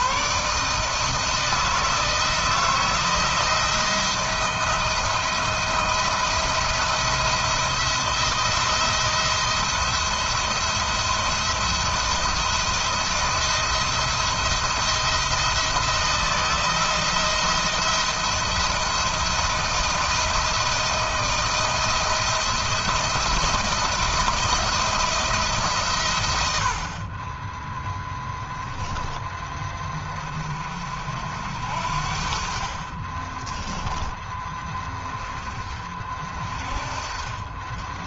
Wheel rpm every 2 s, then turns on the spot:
160, 170, 170, 170, 170, 170, 170, 170, 170, 170, 160, 170, 160, 30, 10, 60, 30, 20, 30.
32-34